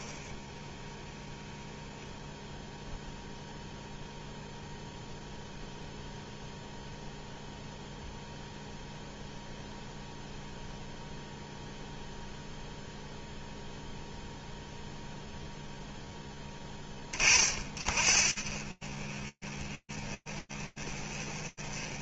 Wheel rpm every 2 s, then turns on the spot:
0, 0, 0, 0, 0, 0, 0, 0, 40, 30, 30.
none